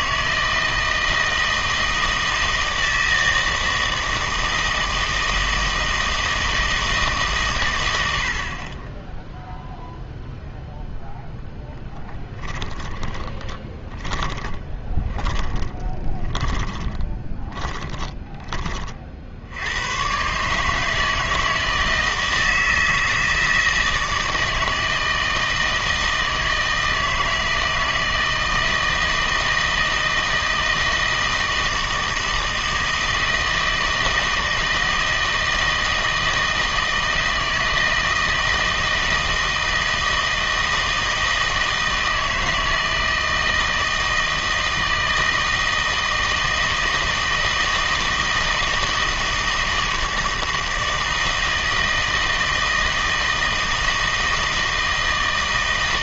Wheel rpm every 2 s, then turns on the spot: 160, 160, 160, 160, 30, 0, 10, 20, 20, 30, 150, 160, 160, 160, 160, 160, 160, 160, 160, 160, 160, 160, 160, 160, 160, 160, 160, 160.
12-18